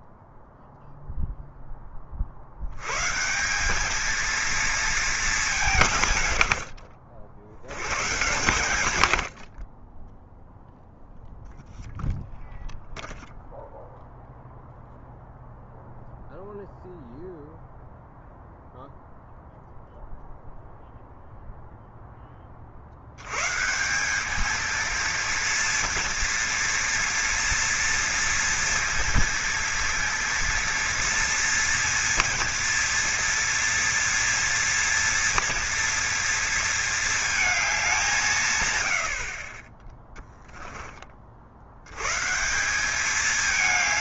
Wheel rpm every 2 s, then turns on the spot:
0, 100, 230, 70, 100, 0, 0, 0, 0, 0, 0, 60, 220, 230, 230, 230, 230, 230, 220, 110, 20, 200.
none